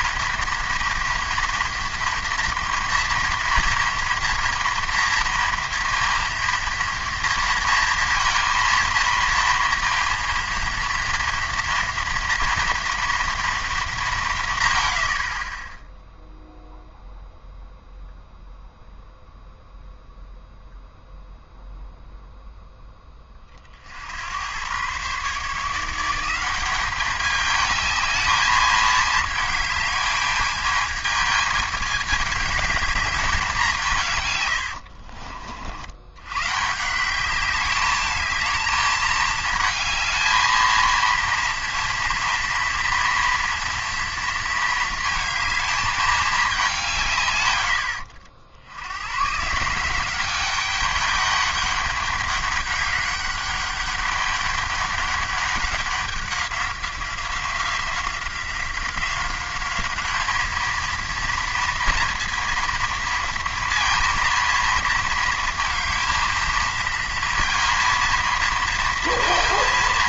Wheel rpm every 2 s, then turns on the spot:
240, 240, 230, 230, 230, 230, 240, 130, 0, 0, 0, 0, 110, 190, 220, 220, 210, 90, 140, 220, 220, 230, 220, 180, 70, 200, 200, 200, 190, 180, 220, 230, 230, 230, 230.
34-36